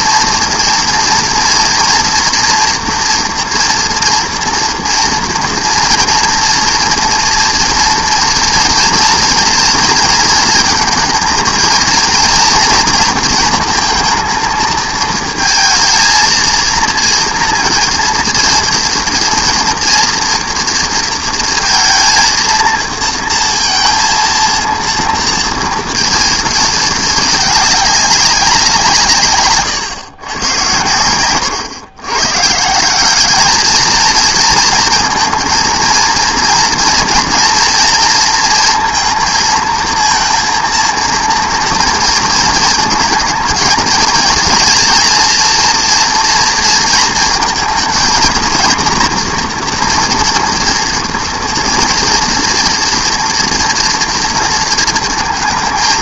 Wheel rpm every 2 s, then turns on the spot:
230, 240, 230, 230, 230, 230, 230, 220, 230, 230, 230, 230, 230, 220, 160, 120, 180, 230, 230, 230, 230, 230, 230, 230, 230, 230, 230, 230.
none